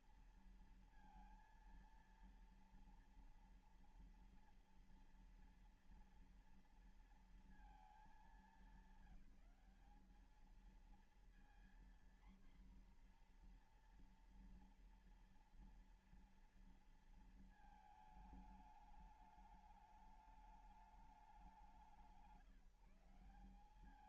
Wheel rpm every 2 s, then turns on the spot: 230, 230, 230, 230, 220, 220, 250, 240, 230, 210, 210, 150.
none